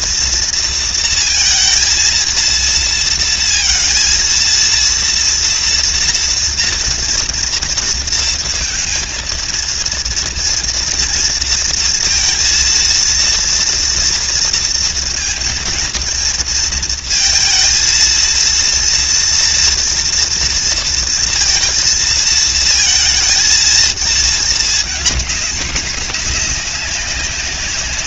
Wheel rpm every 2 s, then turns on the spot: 230, 230, 230, 240, 230, 230, 230, 230, 230, 230, 230, 230, 210, 200.
none